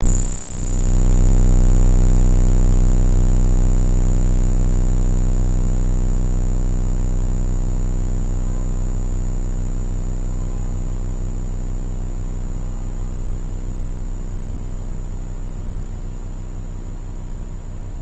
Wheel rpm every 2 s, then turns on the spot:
0, 0, 0, 0, 0, 0, 0, 0, 0.
none